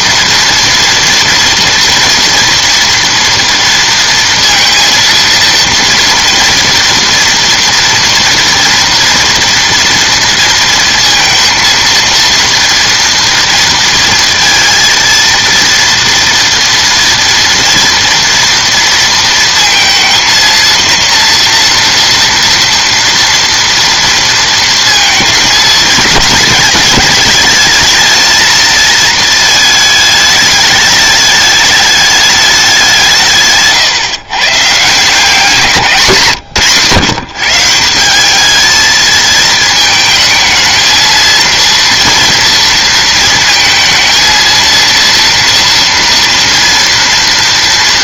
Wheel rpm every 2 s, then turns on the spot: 230, 230, 230, 230, 230, 230, 230, 230, 230, 230, 230, 230, 230, 220, 230, 210, 190, 150, 150, 220, 220, 230, 230, 230.
none